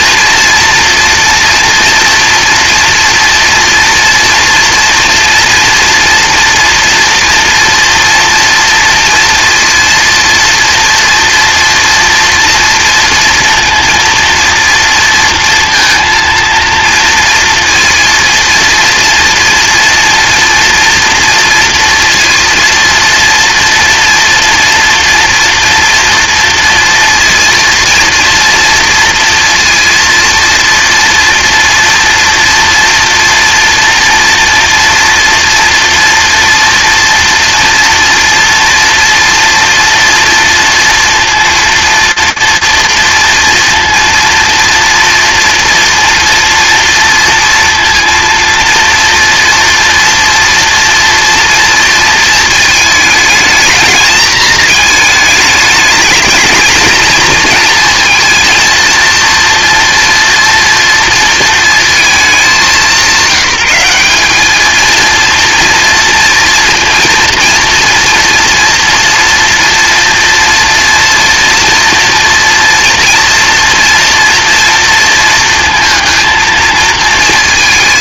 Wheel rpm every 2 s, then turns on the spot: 230, 230, 240, 230, 230, 230, 230, 230, 230, 230, 230, 230, 230, 230, 230, 230, 230, 230, 230, 230, 230, 230, 230, 230, 240, 230, 220, 220, 230, 230, 230, 190, 230, 230, 230, 230, 230, 230, 220.
none